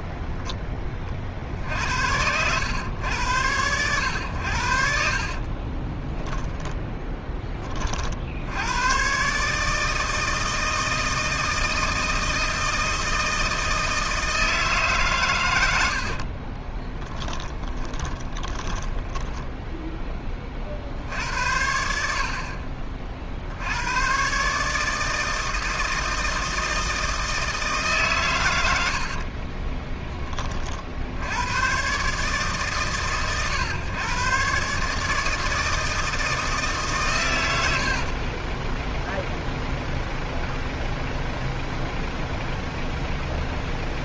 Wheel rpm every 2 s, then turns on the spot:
60, 100, 50, 10, 120, 160, 160, 150, 20, 10, 60, 40, 150, 160, 80, 50, 140, 150, 150, 10, 0, 0.
4-6 16-20 28-30 38-40